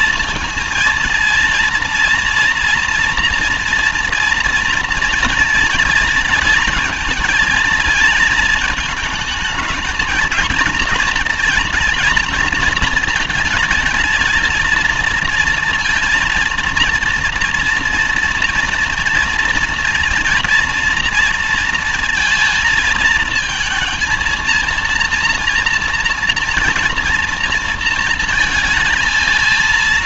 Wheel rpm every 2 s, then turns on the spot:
230, 230, 230, 230, 220, 230, 230, 230, 230, 240, 230, 220, 230, 230, 220.
none